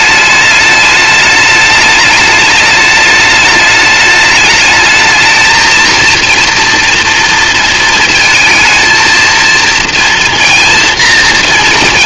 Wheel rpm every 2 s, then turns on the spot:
210, 210, 210, 230, 230, 230.
none